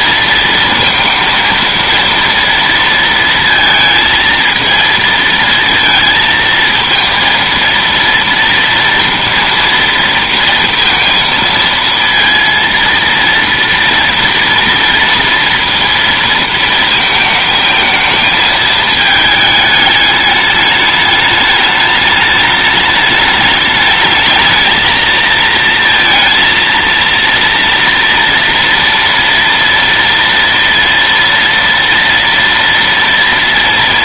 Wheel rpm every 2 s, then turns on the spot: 230, 230, 230, 230, 230, 230, 230, 230, 230, 220, 210, 210, 220, 230, 230, 230, 230.
none